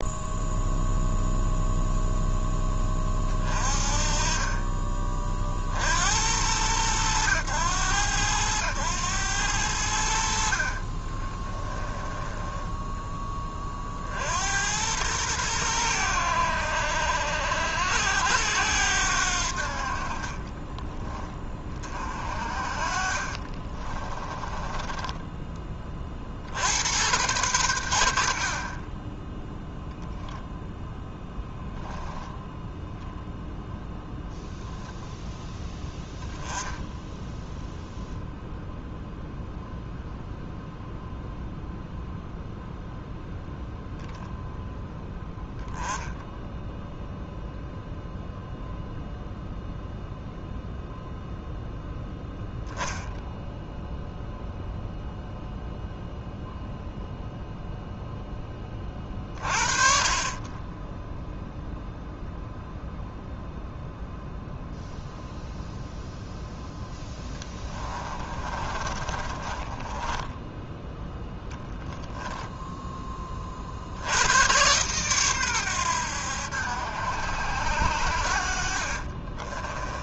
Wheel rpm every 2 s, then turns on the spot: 0, 10, 30, 90, 100, 50, 10, 90, 70, 90, 20, 50, 20, 70, 40, 10, 0, 0, 10, 0, 0, 0, 0, 0, 0, 0, 0, 0, 0, 20, 40, 0, 0, 0, 30, 10, 10, 110, 80, 60.
10-12 20-26 68-74